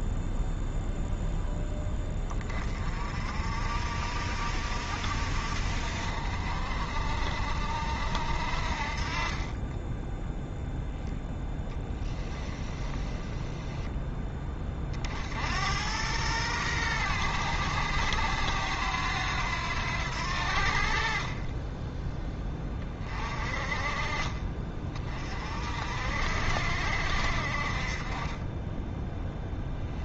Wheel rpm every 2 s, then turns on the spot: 0, 30, 60, 60, 50, 0, 10, 40, 110, 90, 60, 20, 30, 60, 10.
12-14